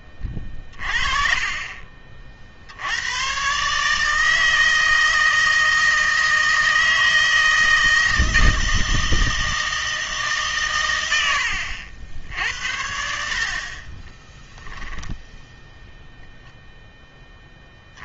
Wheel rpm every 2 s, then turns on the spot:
30, 60, 160, 160, 160, 130, 70, 0, 0.
0-2